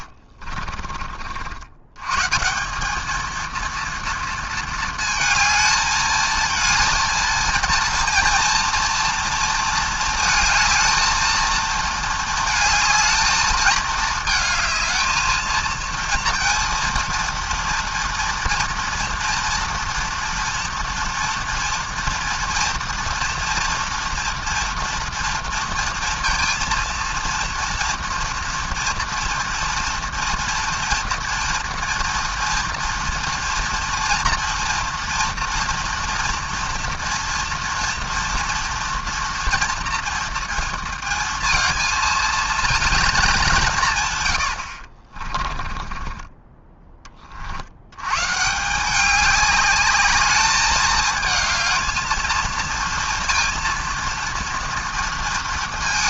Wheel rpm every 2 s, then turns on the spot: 50, 210, 230, 230, 230, 220, 220, 220, 230, 240, 230, 230, 230, 230, 240, 240, 230, 240, 230, 230, 230, 230, 70, 20, 170, 210, 230, 230.
0-2 44-46